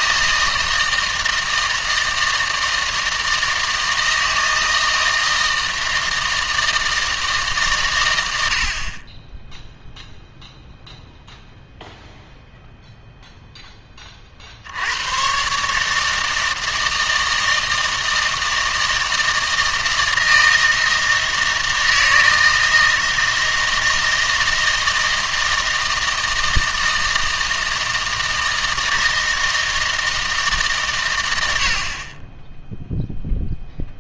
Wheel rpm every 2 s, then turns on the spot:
160, 160, 160, 160, 70, 0, 0, 90, 160, 160, 160, 160, 160, 160, 160, 130, 0.
none